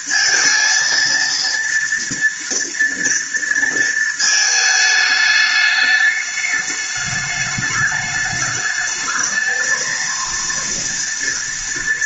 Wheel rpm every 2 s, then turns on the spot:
230, 230, 220, 210, 210, 230.
none